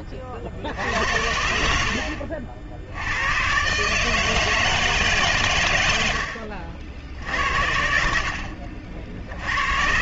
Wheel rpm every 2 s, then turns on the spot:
50, 70, 160, 60, 20.
none